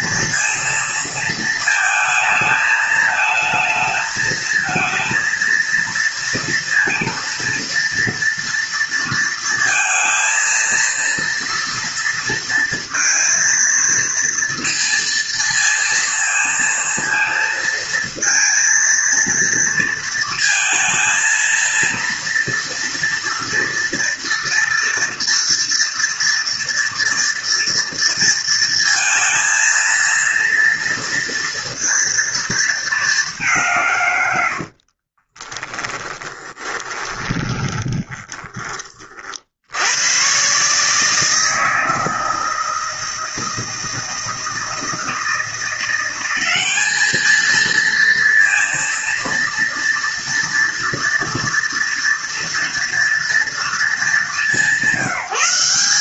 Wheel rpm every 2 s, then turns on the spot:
220, 220, 230, 230, 230, 230, 230, 230, 230, 230, 230, 230, 230, 230, 230, 230, 190, 30, 20, 60, 160, 160, 170, 220, 230, 240, 230, 190.
34-38